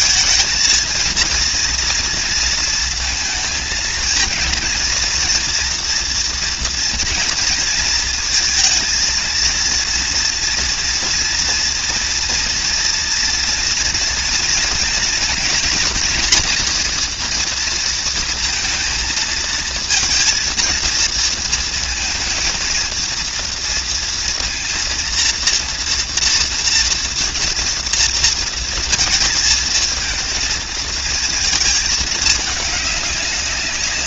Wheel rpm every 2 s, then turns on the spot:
230, 220, 230, 230, 230, 240, 230, 230, 230, 220, 230, 230, 230, 230, 220, 220, 200.
none